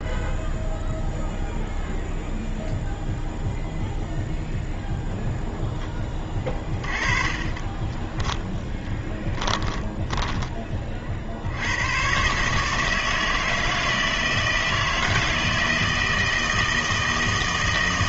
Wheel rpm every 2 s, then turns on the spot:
0, 0, 0, 20, 10, 30, 150, 160, 160.
6-10